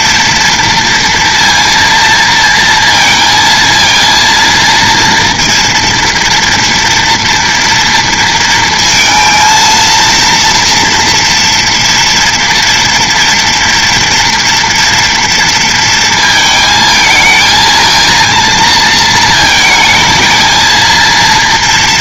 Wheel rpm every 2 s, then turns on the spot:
230, 230, 230, 230, 230, 230, 230, 230, 220, 230, 220.
none